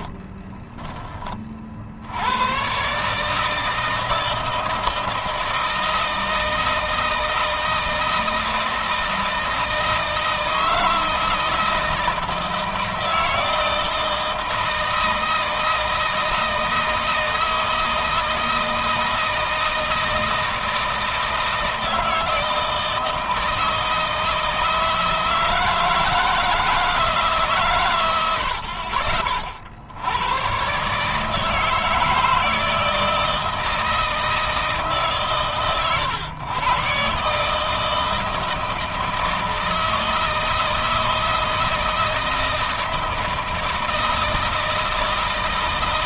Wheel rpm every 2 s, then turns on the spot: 30, 140, 160, 160, 160, 160, 160, 160, 160, 160, 160, 160, 160, 150, 40, 140, 160, 150, 130, 160, 160, 160, 160.
0-2